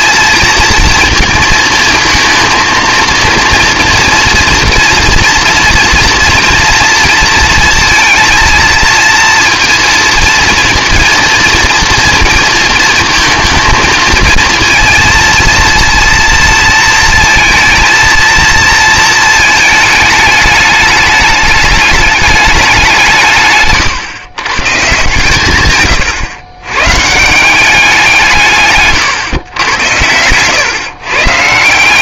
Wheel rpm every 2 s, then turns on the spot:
230, 230, 230, 240, 230, 220, 230, 230, 230, 220, 210, 200, 130, 110, 150, 120.
none